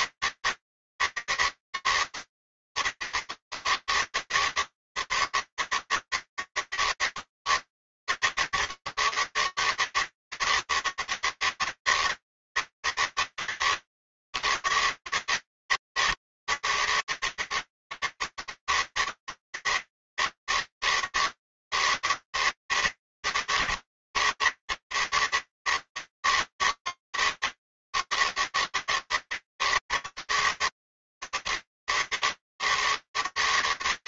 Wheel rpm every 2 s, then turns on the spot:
160, 160, 150, 160, 150, 160, 160, 140, 140, 160, 160, 150, 140, 160, 160, 140, 140.
none